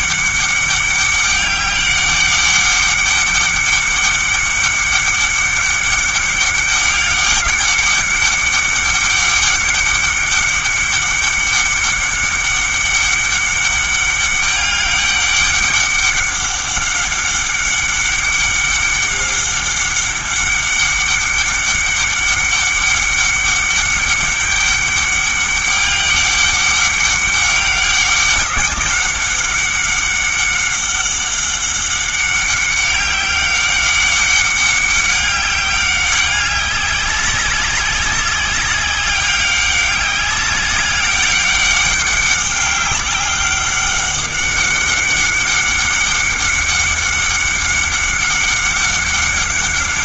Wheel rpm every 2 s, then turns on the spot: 200, 200, 200, 200, 200, 200, 200, 200, 200, 200, 200, 200, 200, 200, 200, 190, 190, 200, 190, 190, 200, 200, 200, 200, 200.
none